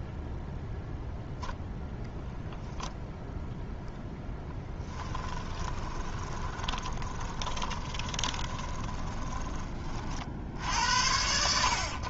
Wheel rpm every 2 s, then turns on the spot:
0, 0, 10, 30, 20, 70.
4-10